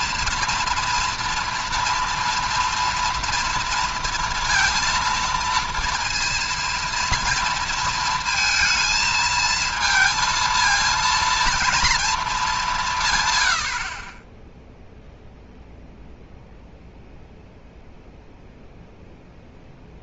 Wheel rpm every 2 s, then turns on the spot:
230, 230, 230, 230, 230, 230, 200, 10, 0, 0.
none